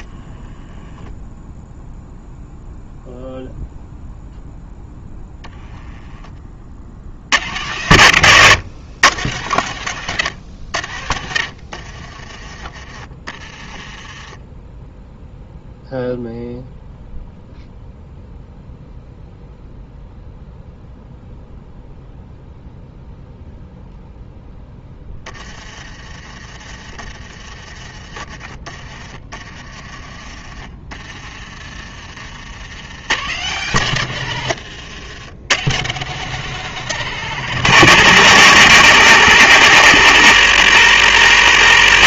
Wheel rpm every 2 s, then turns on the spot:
0, 0, 0, 60, 120, 80, 30, 0, 0, 0, 0, 0, 10, 30, 30, 30, 90, 90, 140, 110, 70.
28-32 34-36